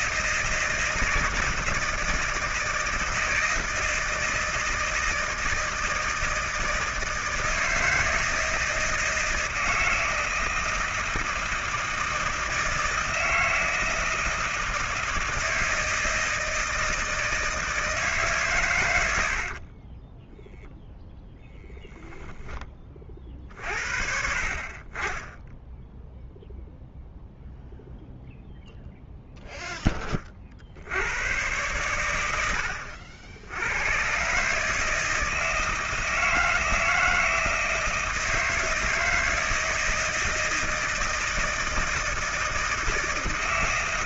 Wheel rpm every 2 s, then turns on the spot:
160, 160, 160, 160, 160, 160, 160, 160, 160, 110, 0, 20, 30, 0, 0, 60, 80, 150, 160, 160, 160, 160.
none